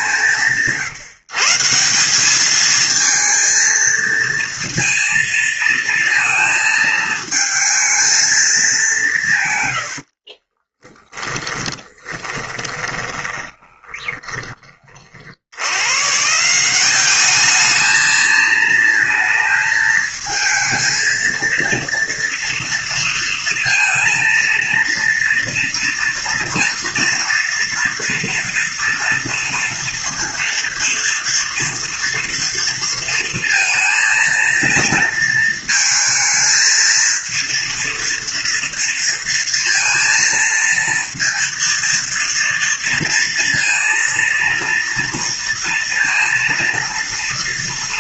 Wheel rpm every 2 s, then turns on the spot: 150, 220, 230, 220, 160, 20, 20, 50, 200, 220, 230, 230, 230, 230, 230, 230, 230, 220, 230, 230, 230, 230, 230, 220.
10-14